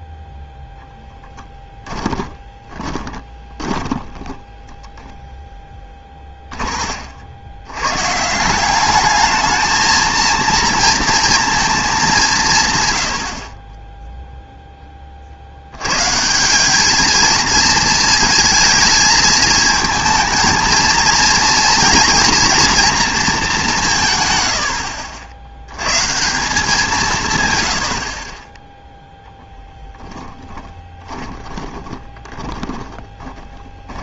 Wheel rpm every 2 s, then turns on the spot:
0, 20, 10, 50, 210, 230, 130, 10, 200, 220, 230, 240, 80, 180, 10, 10, 20.
2-6 30-34